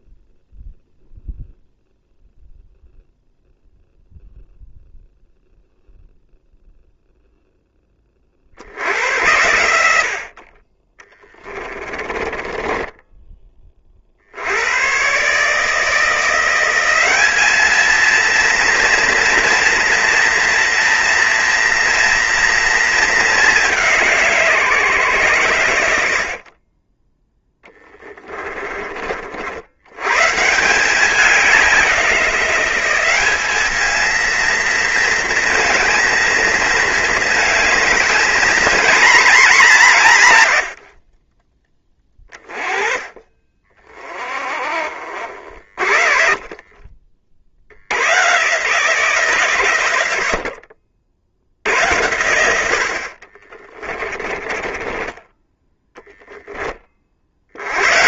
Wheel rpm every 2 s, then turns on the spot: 0, 0, 0, 0, 70, 20, 10, 100, 180, 230, 230, 220, 140, 30, 30, 170, 190, 230, 220, 240, 80, 40, 40, 30, 140, 50, 70, 20, 20.
12-14 26-28 54-56